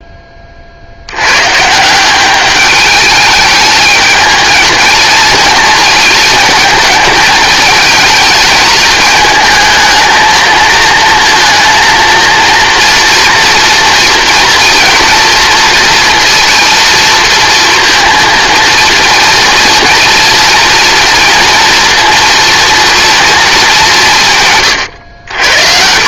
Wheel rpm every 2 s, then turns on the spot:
50, 210, 230, 220, 220, 220, 230, 230, 230, 230, 230, 240, 110.
24-26